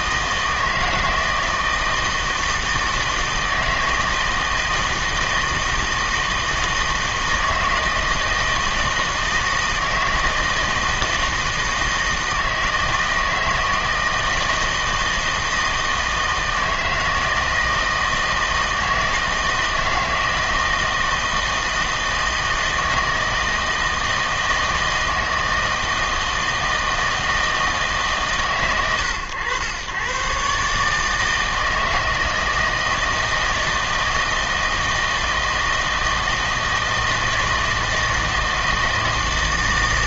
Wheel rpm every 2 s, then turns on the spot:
160, 160, 160, 160, 160, 160, 160, 160, 160, 160, 160, 160, 160, 160, 130, 150, 160, 160, 160, 160.
none